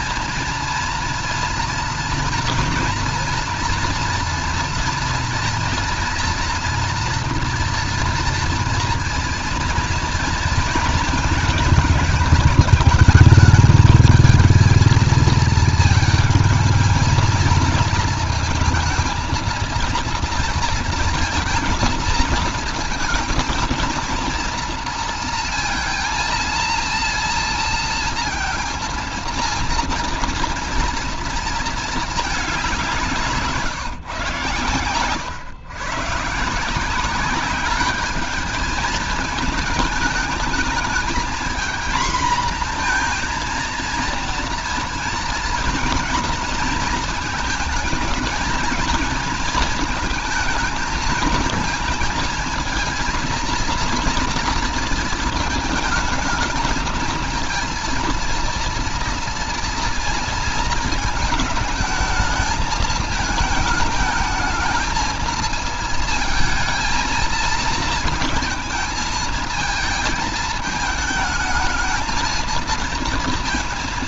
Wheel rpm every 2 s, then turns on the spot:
230, 230, 230, 230, 230, 230, 210, 220, 220, 220, 230, 230, 230, 230, 230, 230, 190, 110, 160, 220, 220, 230, 230, 230, 220, 220, 220, 230, 220, 230, 230, 220, 220, 220, 230, 220, 230.
none